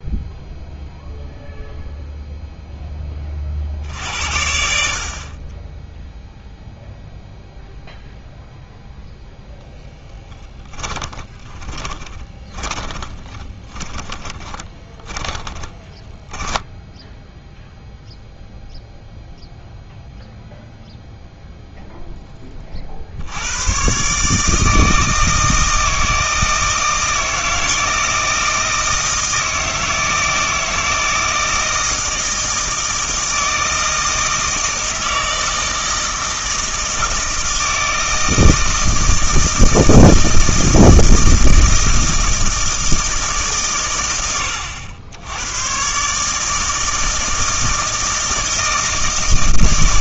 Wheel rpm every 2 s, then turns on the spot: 0, 0, 70, 0, 0, 20, 20, 20, 10, 0, 0, 20, 150, 160, 160, 160, 160, 160, 160, 160, 160, 160, 90, 150, 160.
10-18